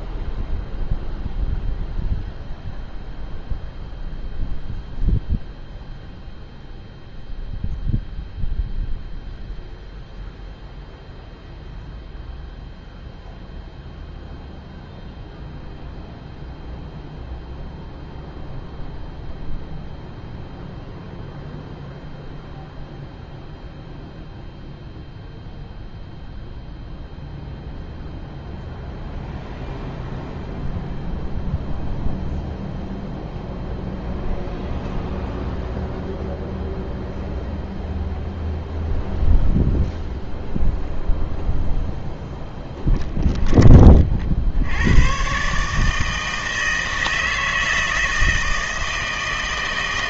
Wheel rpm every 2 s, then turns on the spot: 0, 0, 0, 0, 0, 0, 0, 0, 0, 0, 0, 0, 0, 0, 0, 0, 0, 0, 0, 0, 0, 10, 70, 160, 160.
42-44